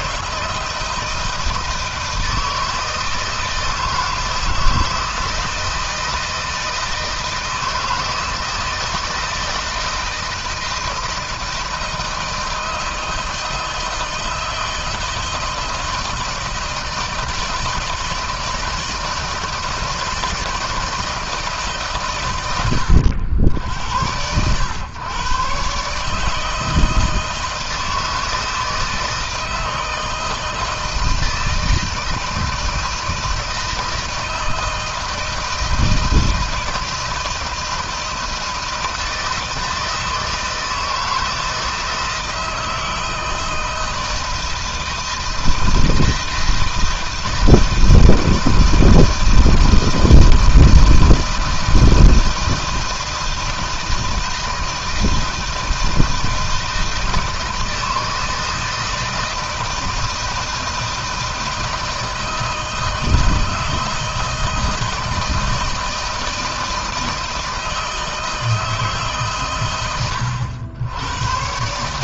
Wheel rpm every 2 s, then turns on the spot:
160, 160, 160, 160, 170, 160, 160, 160, 160, 160, 160, 90, 110, 160, 160, 160, 160, 160, 160, 160, 160, 160, 160, 160, 160, 160, 160, 160, 160, 160, 160, 160, 160, 160, 160, 100.
none